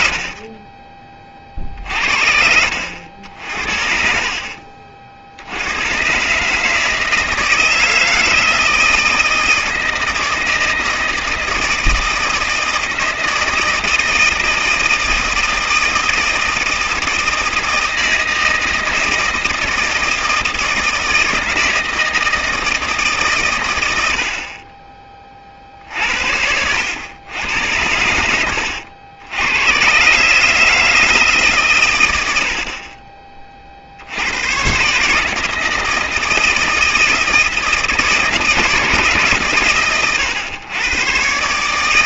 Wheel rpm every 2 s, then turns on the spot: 40, 70, 40, 150, 160, 160, 160, 170, 160, 160, 160, 160, 40, 80, 80, 150, 60, 120, 160, 160, 110.
4-6